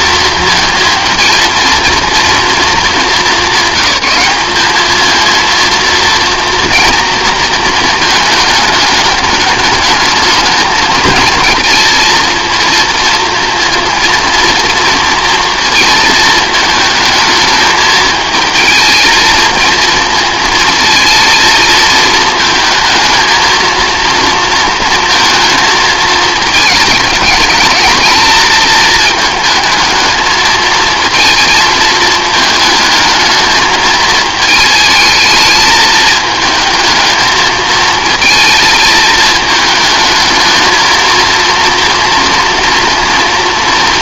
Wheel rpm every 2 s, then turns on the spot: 230, 220, 210, 230, 220, 220, 230, 240, 220, 220, 230, 220, 230, 220, 220, 220, 220, 220, 220, 220, 220, 230.
none